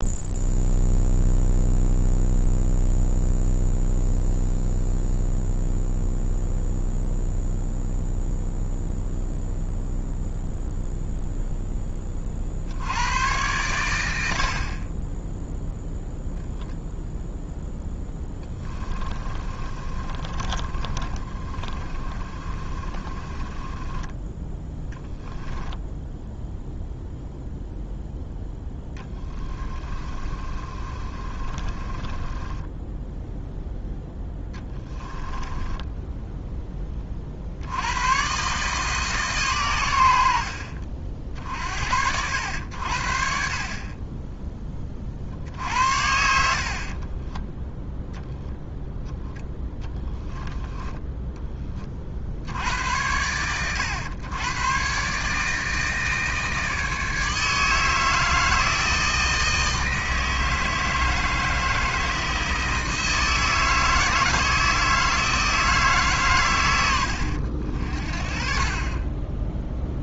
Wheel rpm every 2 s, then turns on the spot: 0, 0, 0, 0, 0, 0, 70, 30, 0, 20, 30, 30, 10, 0, 10, 30, 10, 10, 20, 150, 50, 70, 30, 40, 10, 10, 90, 130, 160, 160, 160, 160, 160, 90, 30.
18-24 30-36 46-48